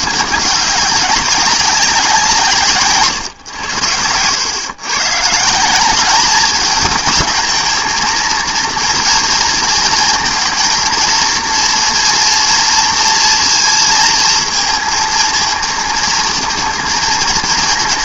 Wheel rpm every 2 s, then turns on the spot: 200, 150, 110, 210, 230, 230, 230, 230, 230.
none